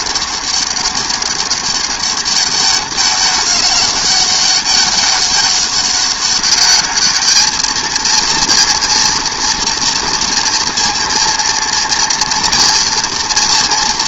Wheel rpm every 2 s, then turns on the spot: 200, 200, 200, 200, 230, 230, 230.
none